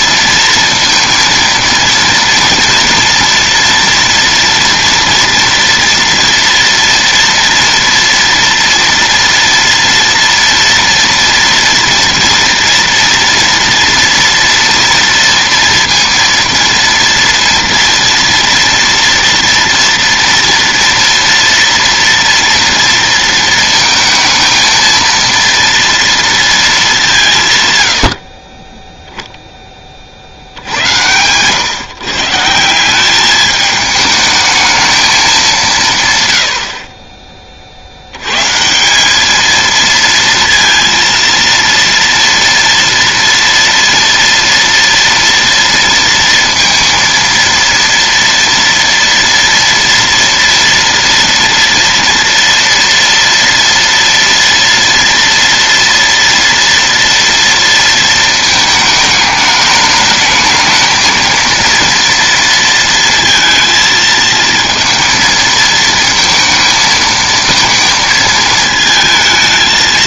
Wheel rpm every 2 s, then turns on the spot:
230, 230, 230, 230, 230, 230, 230, 230, 230, 230, 230, 230, 230, 220, 20, 80, 160, 220, 80, 160, 230, 230, 230, 230, 230, 230, 230, 230, 230, 220, 220, 230, 230, 220, 220.
none